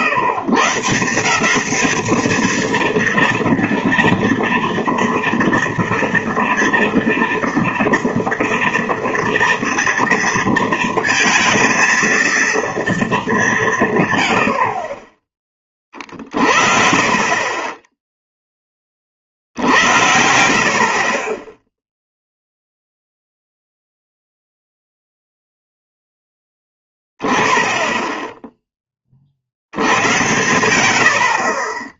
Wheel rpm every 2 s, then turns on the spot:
150, 230, 230, 230, 230, 230, 230, 60, 40, 10, 60, 0, 0, 10, 10, 90.
none